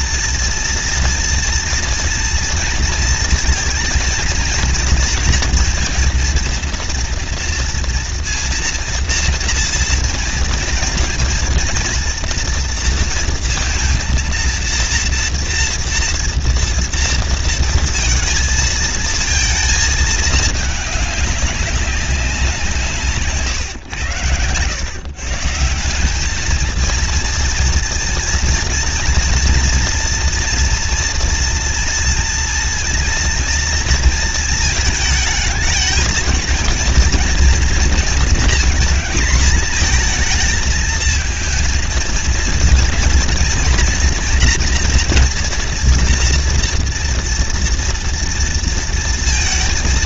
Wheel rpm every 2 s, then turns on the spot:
230, 230, 230, 230, 240, 230, 230, 230, 230, 230, 210, 180, 110, 220, 230, 230, 230, 230, 230, 230, 220, 230, 240, 230, 230.
none